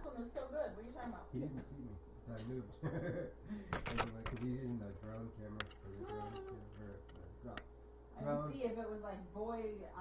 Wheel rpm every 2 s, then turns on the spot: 0, 0, 0, 0, 0.
none